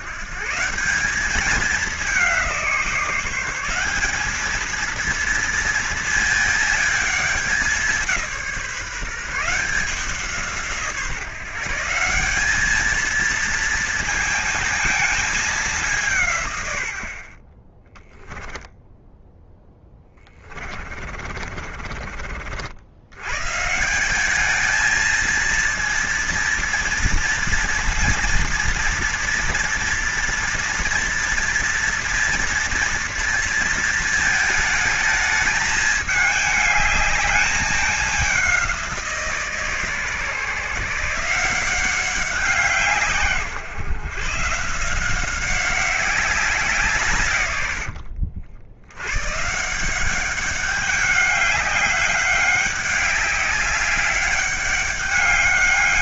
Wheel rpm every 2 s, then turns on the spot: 170, 180, 220, 220, 170, 160, 210, 220, 120, 10, 30, 70, 210, 230, 230, 230, 230, 220, 210, 190, 150, 170, 150, 170, 80, 200, 200, 200.
18-22